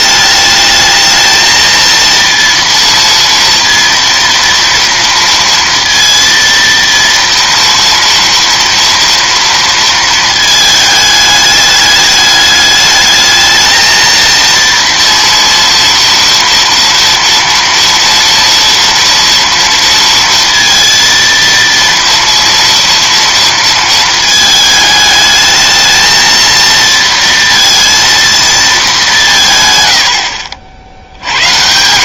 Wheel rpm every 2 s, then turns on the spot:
210, 230, 230, 230, 230, 220, 210, 230, 230, 230, 230, 230, 220, 230, 220, 60.
none